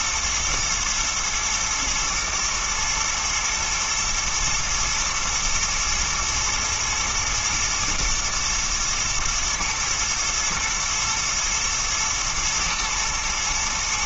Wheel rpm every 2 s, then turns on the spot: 120, 110, 120, 120, 120, 110, 120.
none